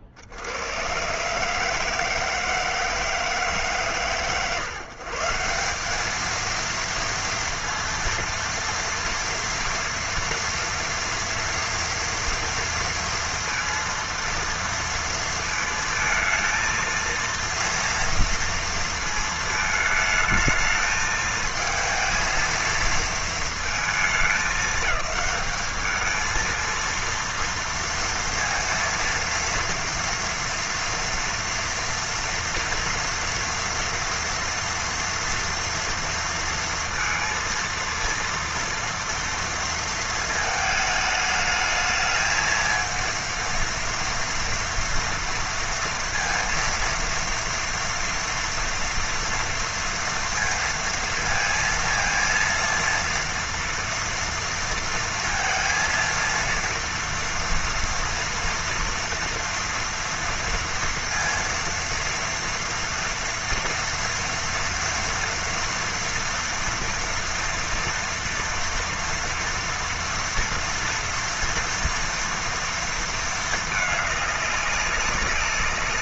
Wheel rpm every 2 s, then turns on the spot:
80, 160, 130, 220, 230, 230, 230, 230, 230, 230, 220, 230, 210, 220, 230, 230, 230, 240, 230, 230, 220, 220, 230, 230, 230, 230, 230, 230, 230, 230, 230, 230, 230, 230, 230, 230, 230, 200.
none